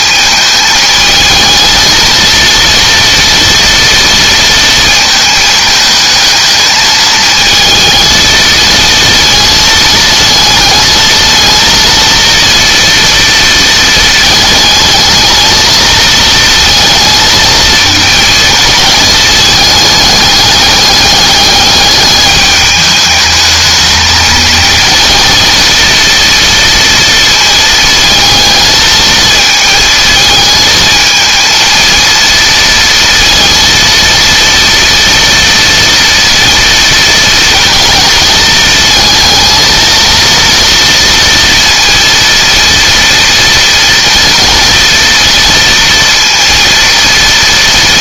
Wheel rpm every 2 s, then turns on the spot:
220, 230, 230, 220, 230, 220, 230, 220, 220, 220, 210, 210, 230, 230, 220, 220, 230, 230, 230, 220, 230, 230, 240, 230.
none